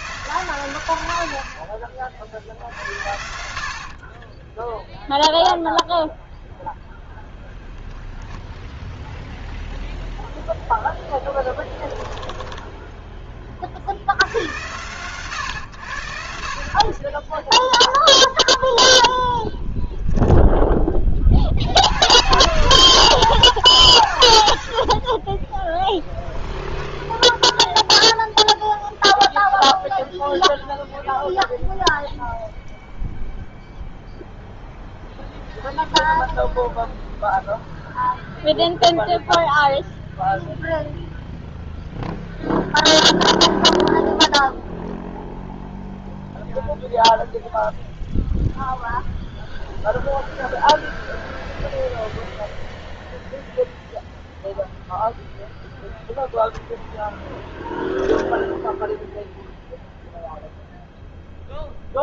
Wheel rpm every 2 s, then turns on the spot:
100, 70, 0, 0, 0, 0, 10, 110, 40, 0, 20, 120, 30, 0, 0, 0, 0, 0, 0, 0, 0, 0, 0, 0, 0, 0, 0, 0, 0, 0, 0.
none